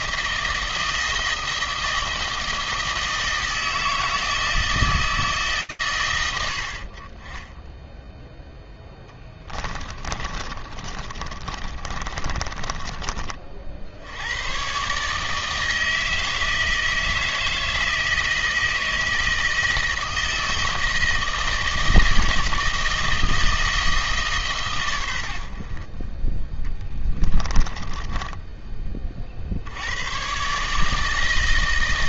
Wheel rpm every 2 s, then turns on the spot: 160, 160, 160, 90, 0, 30, 30, 130, 160, 160, 160, 160, 120, 10, 30, 160.
10-14 26-28